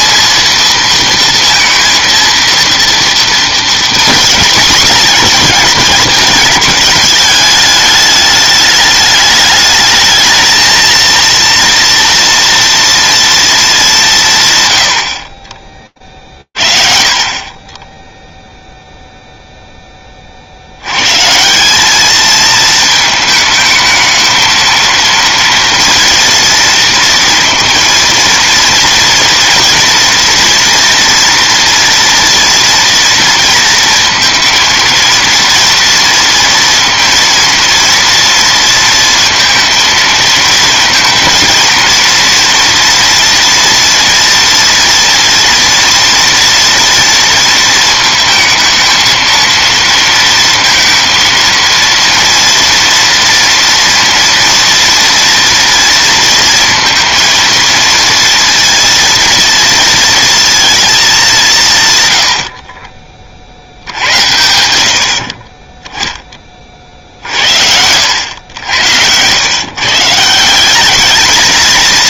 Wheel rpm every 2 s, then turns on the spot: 230, 230, 220, 210, 210, 230, 230, 30, 60, 0, 90, 220, 230, 230, 230, 240, 230, 230, 230, 230, 230, 230, 230, 230, 220, 230, 230, 230, 230, 230, 220, 40, 70, 50, 90, 210.
none